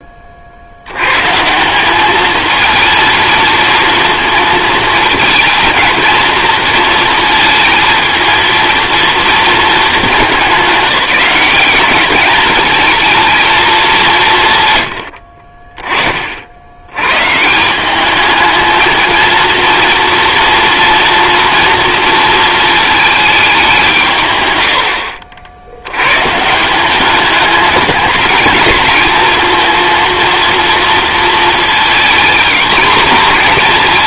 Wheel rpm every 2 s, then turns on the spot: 90, 230, 230, 230, 230, 200, 220, 100, 90, 220, 230, 220, 80, 180, 220, 230, 240.
none